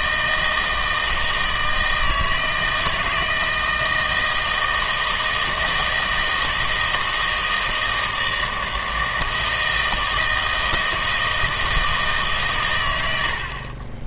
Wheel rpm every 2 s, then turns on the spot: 160, 160, 160, 160, 160, 160, 120.
none